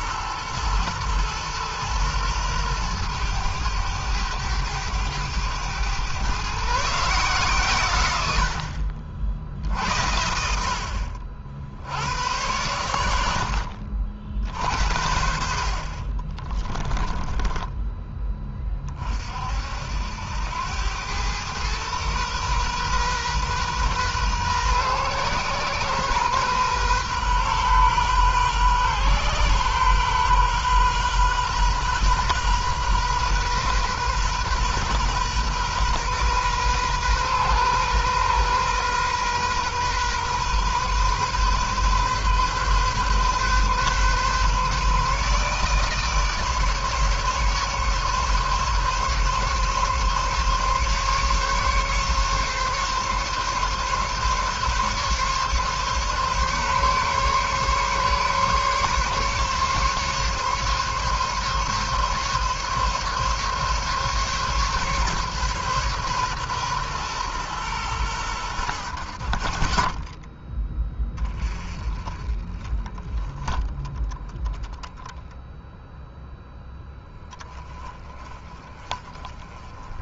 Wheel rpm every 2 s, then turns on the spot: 110, 110, 100, 140, 60, 70, 90, 60, 20, 30, 100, 130, 120, 130, 130, 120, 130, 130, 130, 130, 130, 130, 140, 150, 140, 140, 140, 140, 140, 140, 140, 140, 140, 120, 70, 20, 20, 0, 20, 20.
16-18